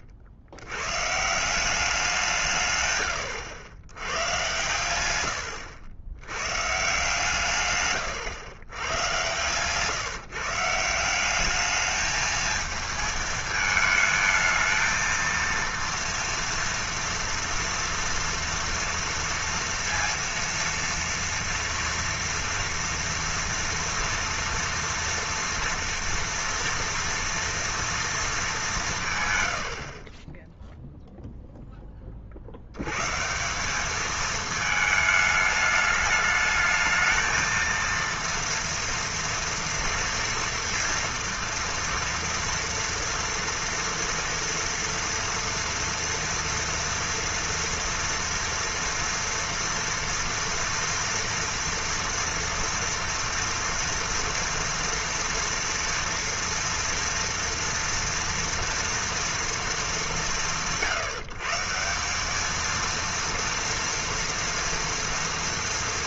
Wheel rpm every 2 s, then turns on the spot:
70, 130, 110, 130, 120, 160, 220, 220, 230, 230, 230, 230, 240, 230, 200, 0, 80, 220, 220, 230, 240, 230, 230, 230, 230, 230, 230, 230, 230, 230, 140, 220, 230.
none